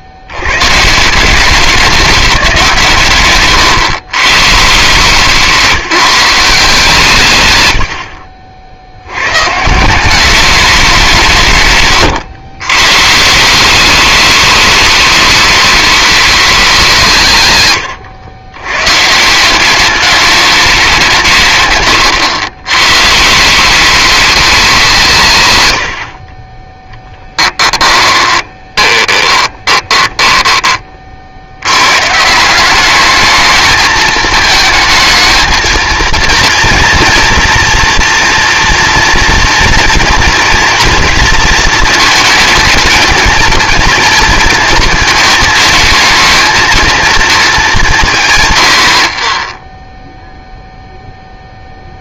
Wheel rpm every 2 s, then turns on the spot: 80, 170, 140, 180, 60, 200, 120, 210, 200, 110, 200, 110, 200, 20, 20, 20, 170, 220, 240, 230, 230, 220, 230, 220, 110, 0.
28-30